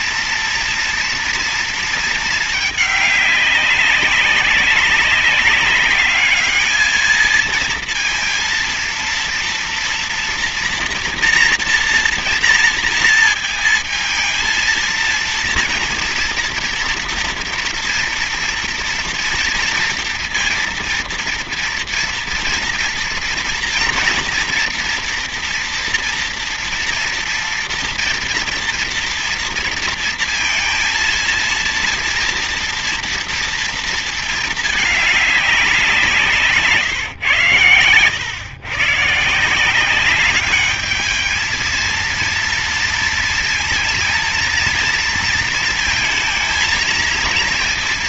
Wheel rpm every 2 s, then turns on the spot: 230, 210, 190, 210, 230, 230, 230, 230, 230, 230, 230, 230, 240, 230, 230, 230, 230, 220, 150, 120, 200, 230, 230, 230.
none